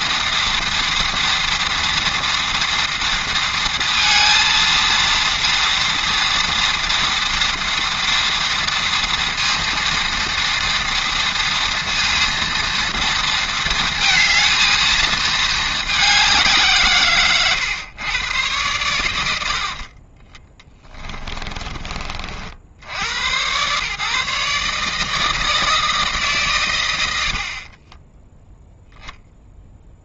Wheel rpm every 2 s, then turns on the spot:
230, 240, 230, 240, 230, 230, 230, 230, 170, 110, 20, 60, 150, 120, 0.
20-22